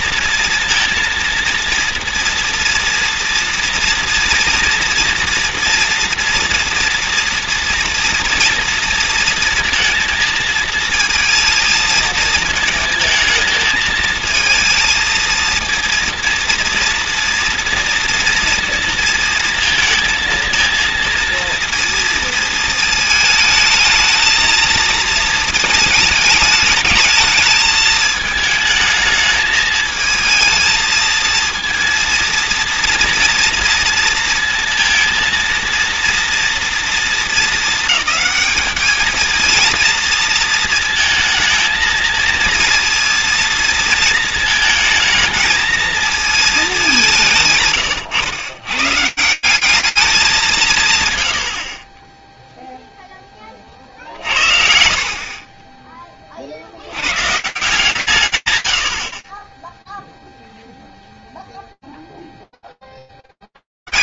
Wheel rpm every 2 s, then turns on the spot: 230, 230, 230, 230, 230, 220, 230, 220, 230, 230, 230, 220, 230, 220, 220, 220, 230, 230, 230, 220, 230, 230, 220, 200, 130, 140, 0, 60, 90, 100, 0, 10.
none